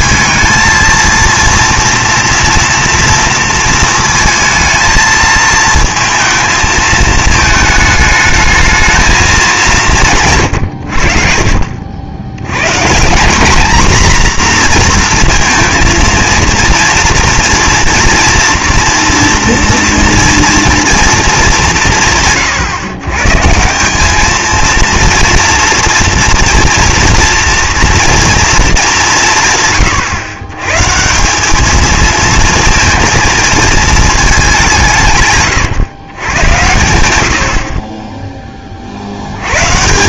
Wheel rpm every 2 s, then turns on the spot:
230, 230, 230, 220, 220, 90, 130, 240, 230, 240, 230, 130, 230, 240, 210, 120, 230, 190, 100, 30.
none